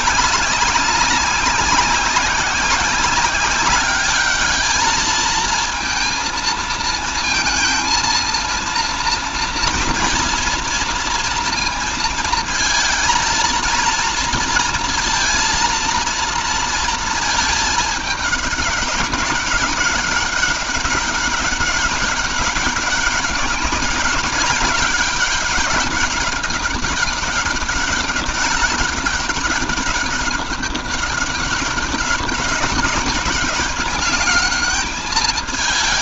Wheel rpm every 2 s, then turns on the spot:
190, 190, 210, 230, 230, 230, 220, 230, 220, 200, 200, 190, 190, 200, 200, 200, 200, 210.
none